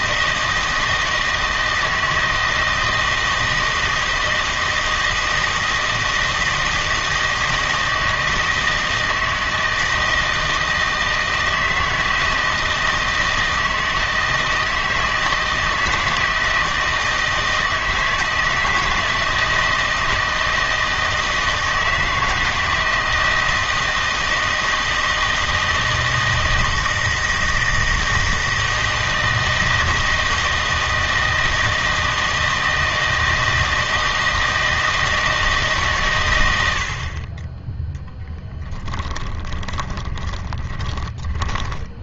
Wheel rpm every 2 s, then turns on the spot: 160, 160, 160, 160, 160, 160, 160, 160, 160, 160, 160, 160, 160, 160, 160, 160, 160, 160, 80, 10, 20.
38-42